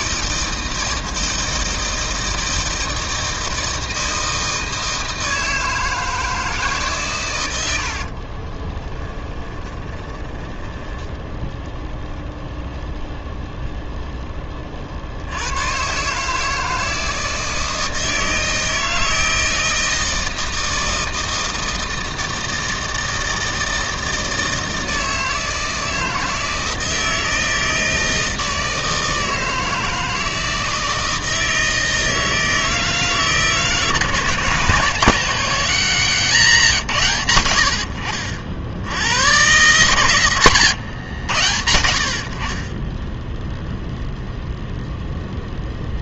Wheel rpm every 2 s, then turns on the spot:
160, 160, 160, 150, 30, 10, 0, 30, 160, 160, 160, 160, 160, 160, 160, 160, 160, 170, 180, 70, 130, 30, 0.
8-12 40-42